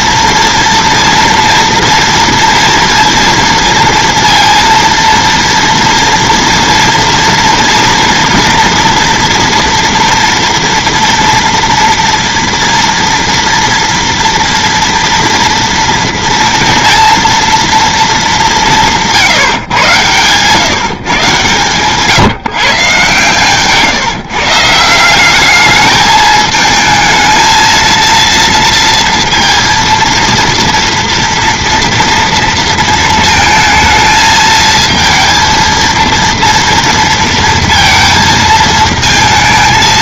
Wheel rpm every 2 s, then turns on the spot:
230, 230, 230, 230, 230, 230, 230, 230, 240, 190, 150, 140, 160, 220, 230, 230, 230, 220, 230, 220.
none